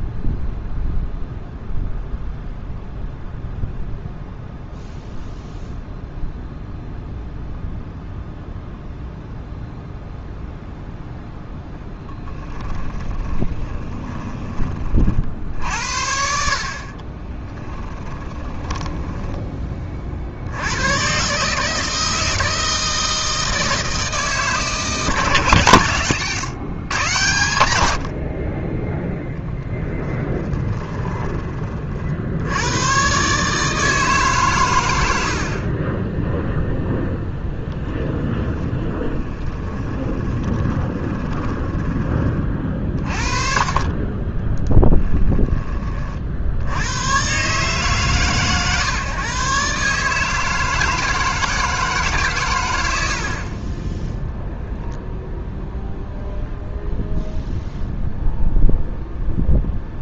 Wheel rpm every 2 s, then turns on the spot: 0, 0, 0, 0, 0, 0, 20, 30, 40, 20, 110, 160, 150, 140, 20, 20, 100, 130, 0, 20, 20, 40, 10, 90, 130, 160, 90, 0, 0, 0.
12-14 16-20 30-32 38-42 44-46